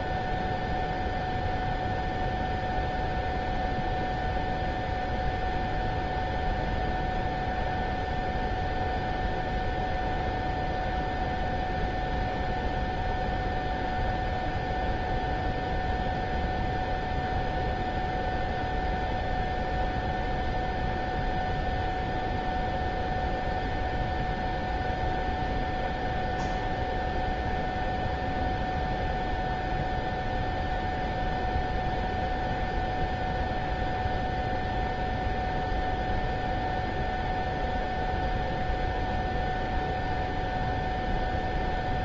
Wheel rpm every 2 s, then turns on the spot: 0, 0, 0, 0, 0, 0, 0, 0, 0, 0, 0, 0, 0, 0, 0, 0, 0, 0, 0, 0, 0.
none